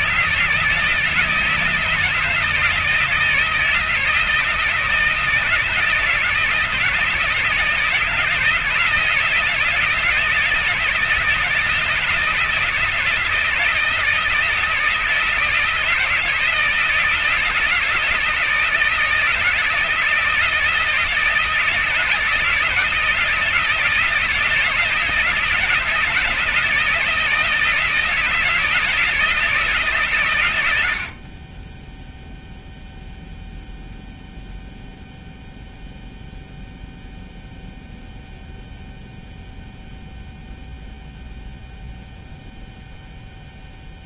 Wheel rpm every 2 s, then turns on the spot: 160, 160, 160, 160, 170, 160, 160, 160, 160, 160, 160, 160, 160, 160, 160, 110, 0, 0, 0, 0, 0, 0.
none